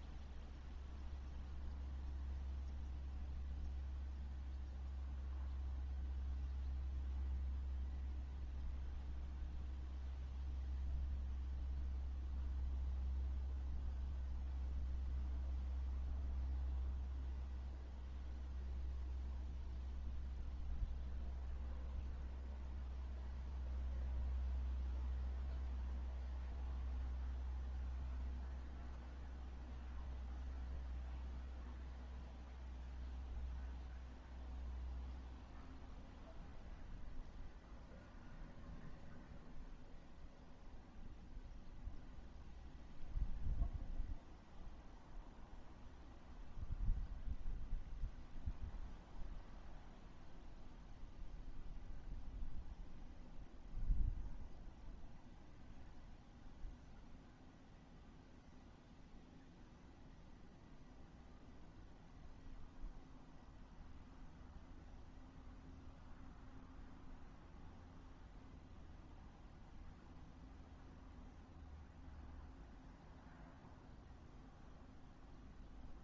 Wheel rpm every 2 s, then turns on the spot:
0, 0, 0, 0, 0, 0, 0, 0, 0, 0, 0, 0, 0, 0, 0, 0, 0, 0, 0, 0, 0, 0, 0, 0, 0, 0, 0, 0, 0, 0, 0, 0, 0, 0, 0, 0, 0, 0.
none